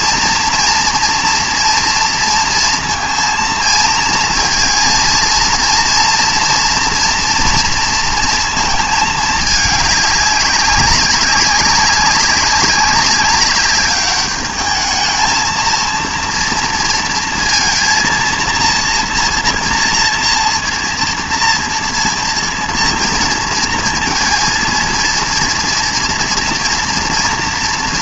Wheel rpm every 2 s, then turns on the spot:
230, 230, 230, 230, 230, 200, 200, 210, 230, 230, 230, 230, 230, 240.
none